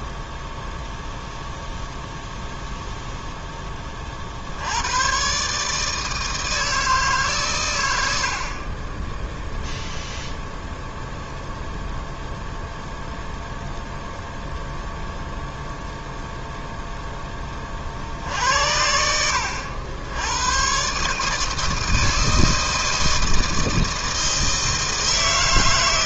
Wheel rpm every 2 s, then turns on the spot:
0, 0, 90, 160, 30, 0, 0, 0, 0, 70, 120, 160, 160.
none